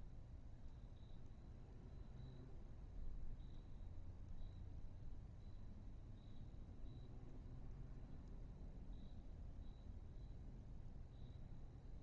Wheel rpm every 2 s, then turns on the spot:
0, 0, 0, 0, 0, 0.
none